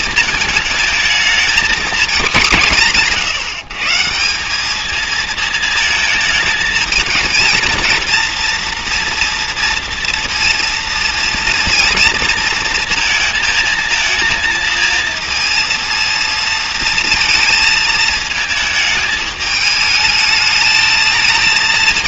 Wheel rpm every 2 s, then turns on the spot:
220, 170, 220, 220, 230, 230, 230, 230, 230, 220, 220.
none